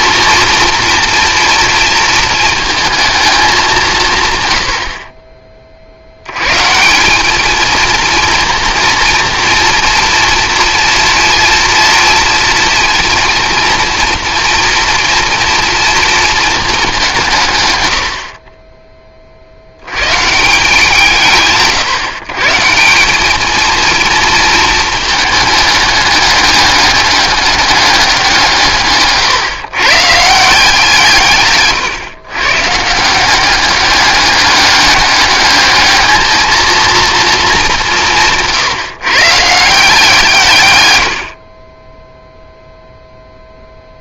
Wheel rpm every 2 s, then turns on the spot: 230, 220, 80, 150, 240, 230, 230, 230, 210, 20, 170, 170, 220, 200, 150, 160, 140, 200, 230, 150, 120, 0.
none